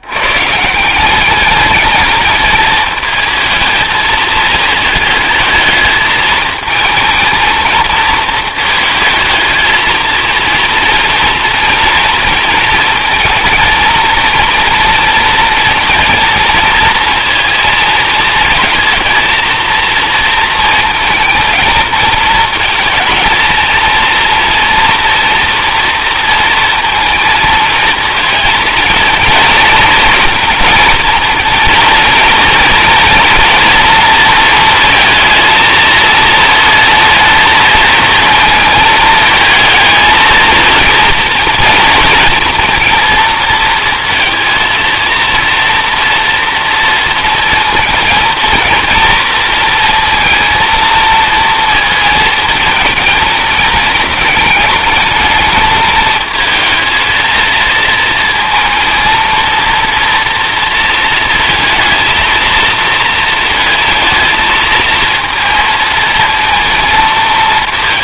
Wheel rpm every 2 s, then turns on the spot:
140, 210, 220, 220, 220, 230, 230, 230, 230, 230, 230, 220, 230, 230, 230, 230, 230, 230, 230, 230, 230, 230, 230, 230, 230, 230, 220, 210, 220, 230, 230, 230, 230, 220.
none